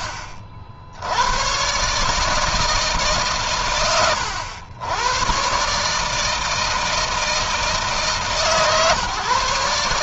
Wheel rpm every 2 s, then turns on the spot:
80, 140, 110, 160, 140.
none